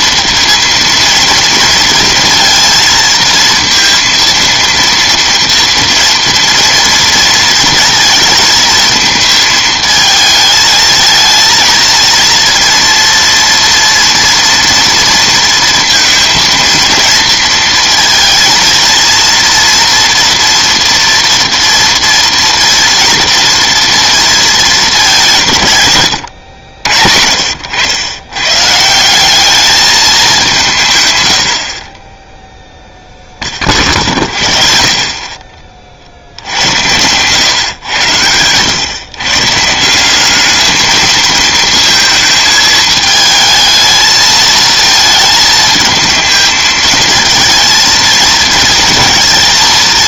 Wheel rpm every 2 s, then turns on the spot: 230, 230, 230, 230, 220, 220, 230, 230, 230, 230, 230, 230, 210, 80, 140, 170, 0, 50, 100, 110, 220, 220, 220, 220, 230.
none